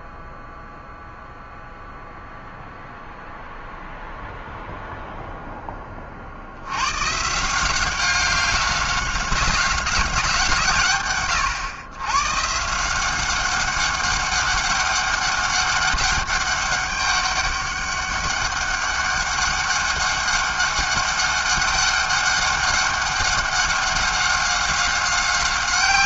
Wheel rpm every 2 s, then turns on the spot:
0, 0, 0, 100, 190, 140, 160, 200, 200, 200, 200, 200, 190.
none